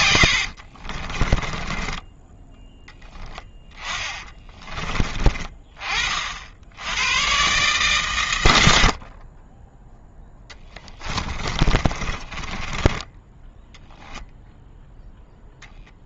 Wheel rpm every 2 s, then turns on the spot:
30, 10, 30, 100, 50, 20, 10, 0.
0-4 10-14